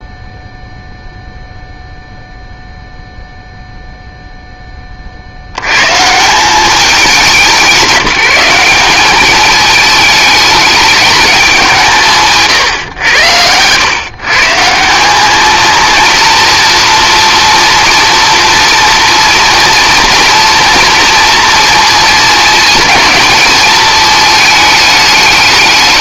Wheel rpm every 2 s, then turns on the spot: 0, 0, 10, 190, 190, 210, 130, 160, 230, 230, 230, 220, 210.
none